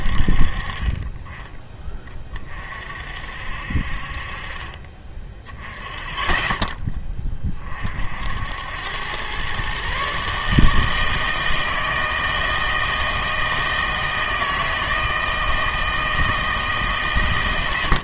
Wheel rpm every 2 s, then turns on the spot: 40, 40, 30, 10, 80, 150, 160, 160, 160.
none